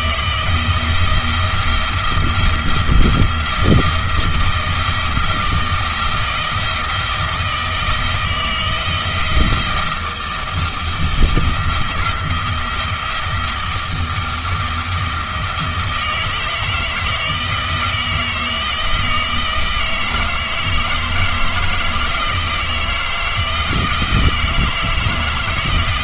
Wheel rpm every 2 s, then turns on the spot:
170, 170, 160, 170, 170, 170, 170, 170, 160, 160, 160, 160, 160.
none